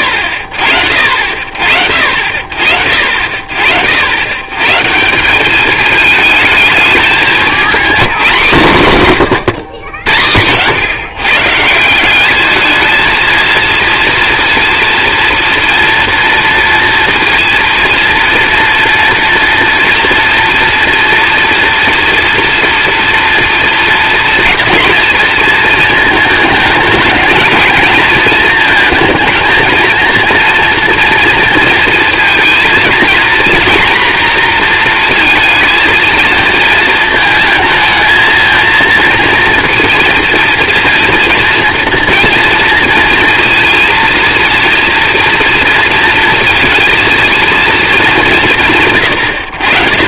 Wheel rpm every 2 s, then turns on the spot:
50, 50, 170, 210, 160, 100, 220, 230, 230, 230, 230, 230, 230, 220, 230, 230, 230, 240, 220, 230, 230, 230, 230, 230, 140.
none